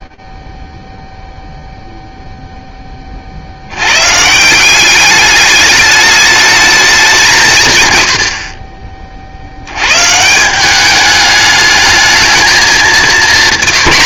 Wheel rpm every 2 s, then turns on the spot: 10, 10, 170, 210, 60, 200, 220.
none